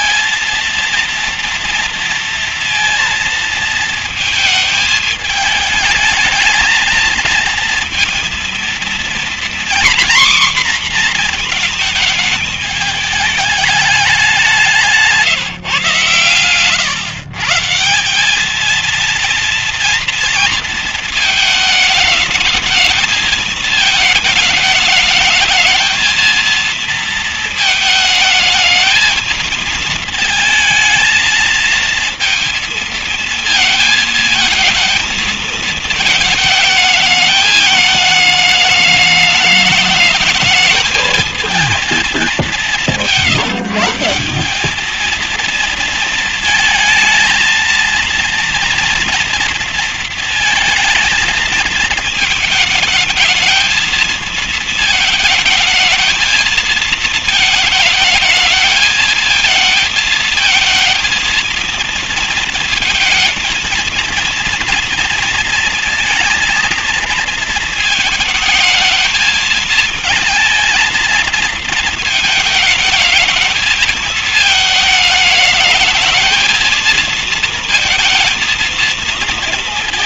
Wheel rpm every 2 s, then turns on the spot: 230, 230, 220, 220, 240, 250, 210, 180, 120, 220, 220, 220, 210, 220, 220, 220, 230, 220, 220, 210, 220, 180, 210, 230, 230, 220, 220, 220, 220, 220, 230, 220, 230, 230, 220, 230, 220, 220, 230, 230.
none